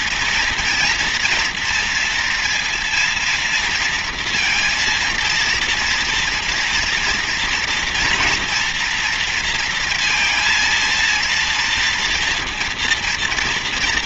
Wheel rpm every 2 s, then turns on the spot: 230, 230, 230, 240, 230, 230, 230.
none